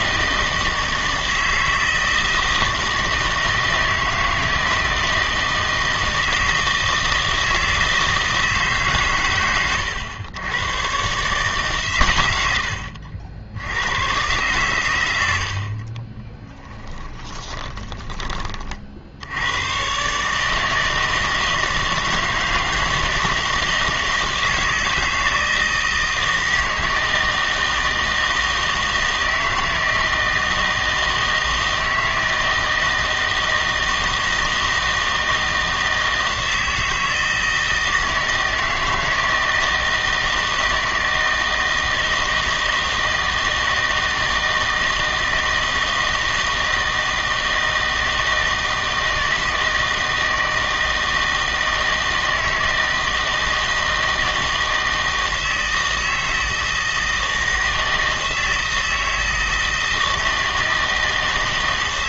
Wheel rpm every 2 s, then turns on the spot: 160, 160, 160, 160, 150, 110, 90, 120, 10, 50, 160, 160, 160, 160, 160, 160, 160, 160, 160, 160, 160, 160, 160, 160, 160, 160, 160, 160, 160, 160, 160.
16-18